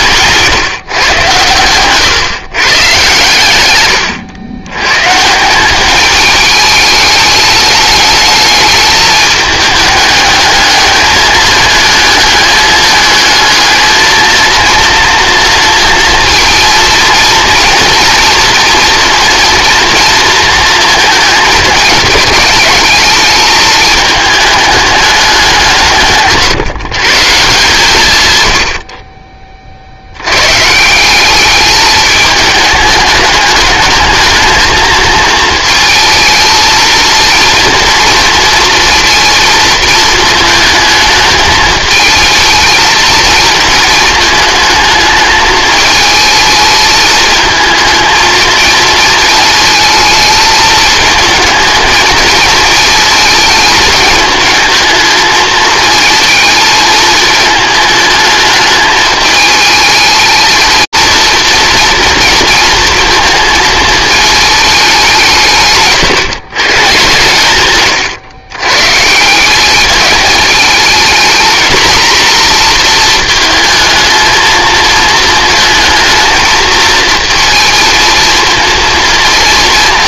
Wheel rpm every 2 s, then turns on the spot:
140, 130, 100, 210, 210, 210, 210, 230, 230, 230, 230, 210, 220, 150, 110, 120, 210, 220, 230, 230, 220, 220, 220, 220, 220, 220, 220, 220, 220, 210, 220, 230, 220, 140, 110, 220, 240, 220, 220, 230.
none